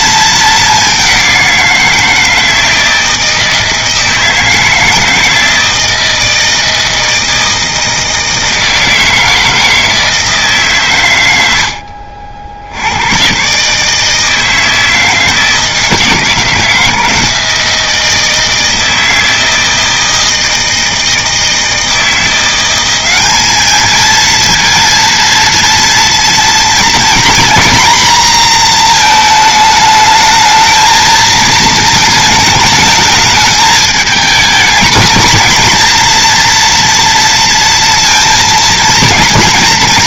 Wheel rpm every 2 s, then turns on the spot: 210, 160, 160, 160, 160, 150, 80, 160, 160, 160, 160, 180, 230, 230, 230, 220, 220, 220, 240, 230.
none